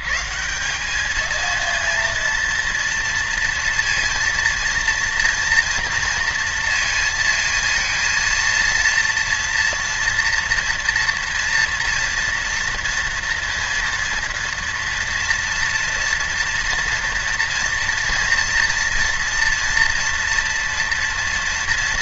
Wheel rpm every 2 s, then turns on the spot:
180, 230, 230, 230, 230, 240, 240, 230, 230, 230, 230.
none